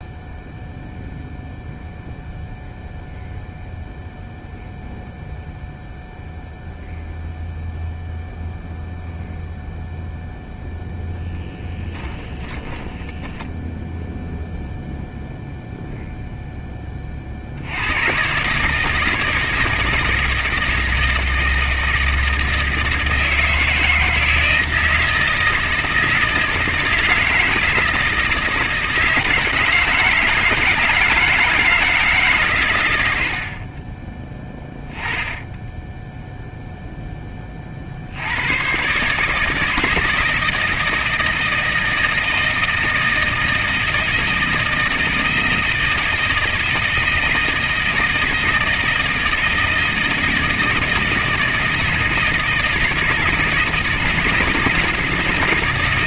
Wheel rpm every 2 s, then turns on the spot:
0, 0, 0, 0, 0, 0, 20, 0, 0, 130, 160, 160, 160, 160, 170, 160, 130, 10, 0, 100, 160, 160, 160, 160, 160, 160, 160, 160.
12-14